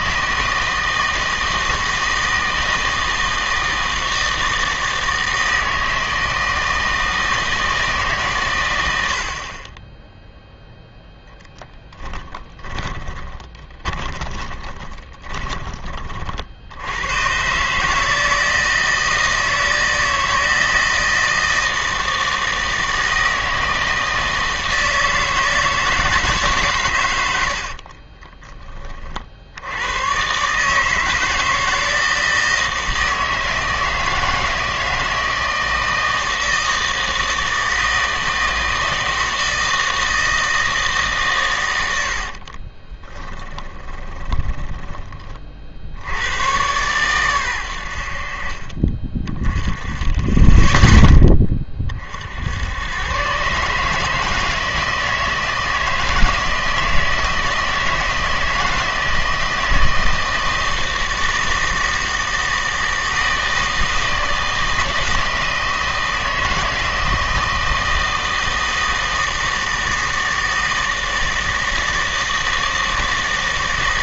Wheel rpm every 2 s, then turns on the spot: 160, 160, 160, 160, 100, 0, 20, 30, 80, 160, 160, 160, 160, 140, 20, 150, 160, 160, 160, 160, 160, 40, 20, 120, 40, 10, 100, 160, 160, 160, 160, 160, 160, 160, 160, 160, 160.
12-16 42-46